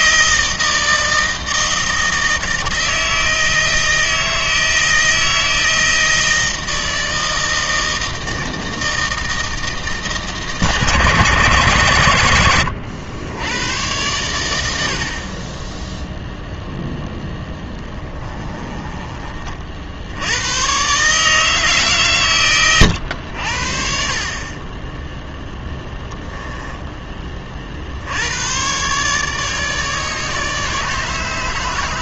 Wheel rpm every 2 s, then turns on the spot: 160, 160, 160, 160, 160, 140, 90, 70, 0, 20, 130, 110, 20, 10, 130, 150.
18-20